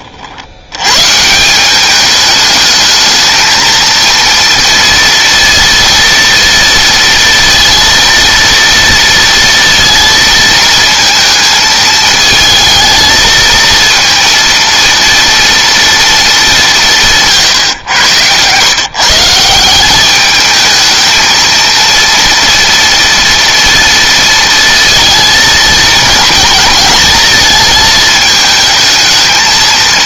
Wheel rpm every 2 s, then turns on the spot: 100, 220, 230, 230, 230, 220, 220, 230, 190, 130, 220, 230, 230, 230, 220.
none